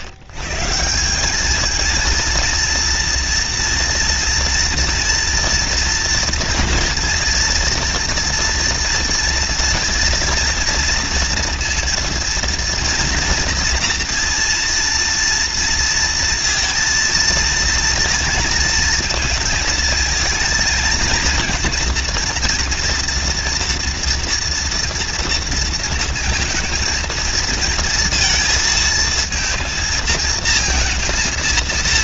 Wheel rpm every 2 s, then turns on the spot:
110, 230, 230, 240, 230, 230, 230, 230, 230, 230, 230, 230, 240, 230, 230, 230.
none